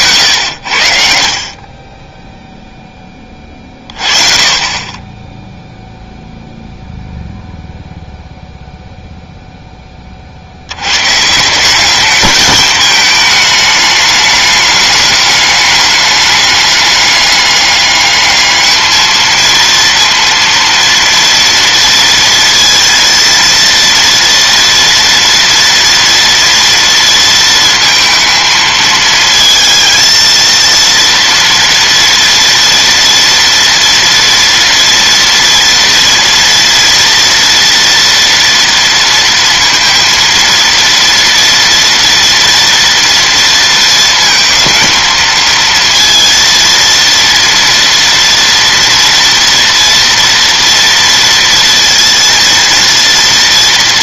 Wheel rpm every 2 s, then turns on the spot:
90, 0, 30, 0, 0, 90, 220, 210, 200, 210, 230, 230, 230, 230, 220, 230, 240, 230, 230, 230, 230, 230, 220, 230, 230, 240, 230.
none